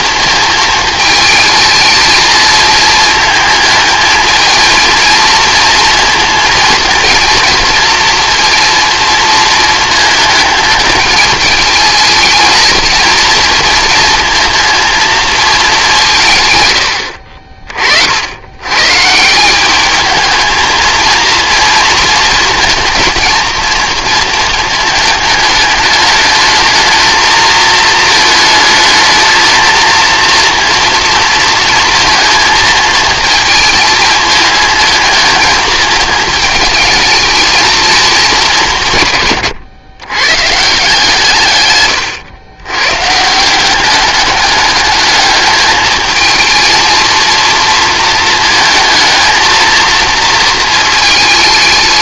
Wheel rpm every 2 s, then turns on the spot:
220, 220, 220, 230, 230, 220, 230, 230, 100, 130, 220, 230, 220, 220, 220, 230, 230, 220, 220, 160, 150, 120, 210, 220, 220, 220.
none